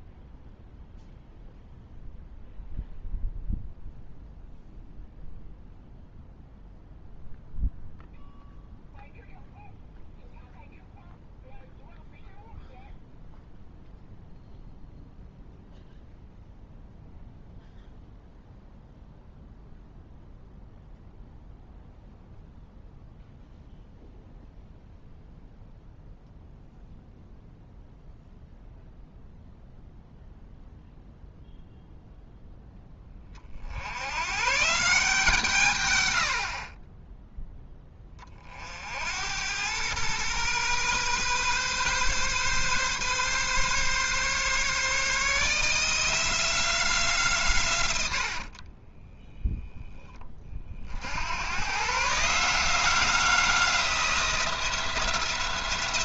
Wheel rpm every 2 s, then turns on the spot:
0, 0, 0, 0, 0, 0, 0, 0, 0, 0, 0, 0, 0, 0, 0, 0, 10, 150, 40, 50, 130, 140, 150, 170, 30, 60, 170, 170.
48-50